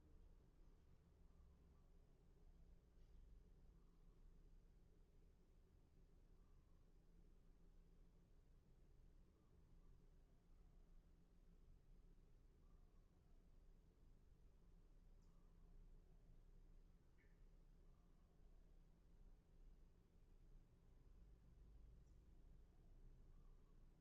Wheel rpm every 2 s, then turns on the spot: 0, 0, 0, 0, 0, 0, 0, 0, 0, 0, 0, 0.
none